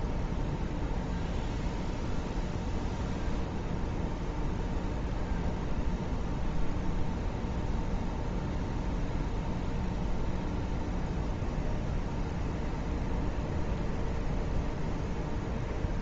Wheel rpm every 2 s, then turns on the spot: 0, 0, 0, 0, 0, 0, 0, 0.
none